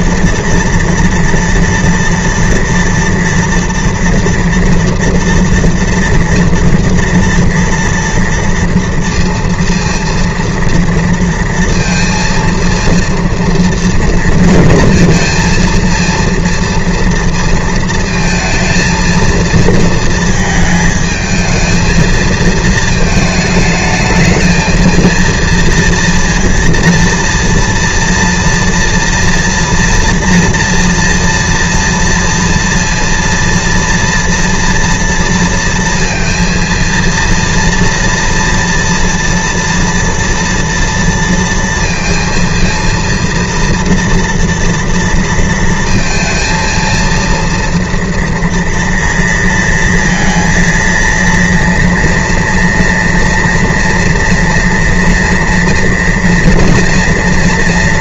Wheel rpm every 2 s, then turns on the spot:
230, 230, 230, 230, 230, 230, 230, 230, 230, 220, 230, 220, 220, 230, 230, 230, 230, 230, 230, 230, 230, 230, 230, 230, 230, 230, 230, 240, 230.
none